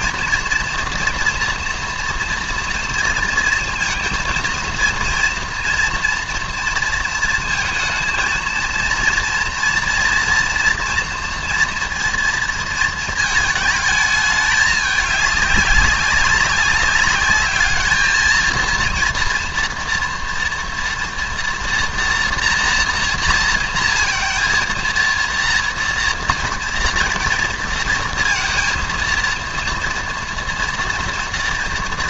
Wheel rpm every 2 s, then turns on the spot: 230, 240, 230, 230, 230, 230, 230, 210, 190, 230, 230, 240, 230, 230, 230, 230.
none